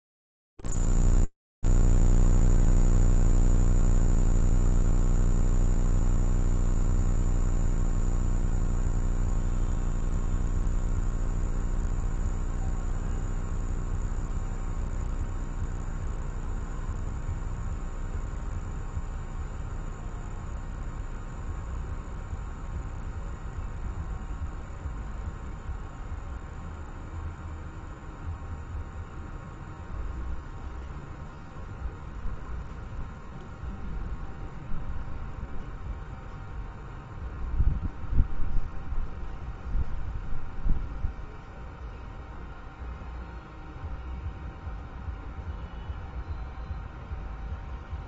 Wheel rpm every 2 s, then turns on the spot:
0, 0, 0, 0, 0, 0, 0, 0, 0, 0, 0, 0, 0, 0, 0, 0, 0, 0, 0, 0, 0, 0, 0, 0.
none